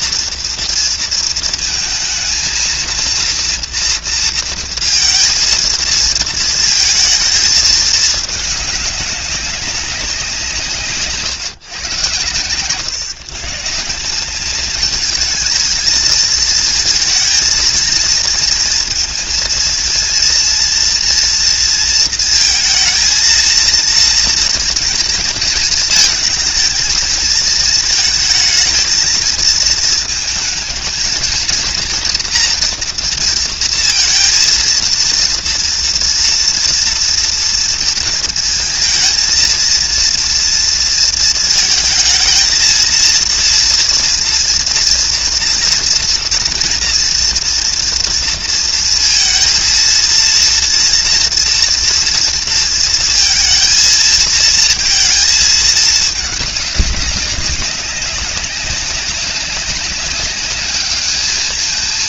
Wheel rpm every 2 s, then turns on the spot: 230, 230, 230, 220, 210, 170, 120, 210, 230, 230, 230, 230, 230, 220, 220, 220, 230, 230, 230, 230, 230, 220, 230, 230, 230, 230, 230, 230, 210, 190, 200.
none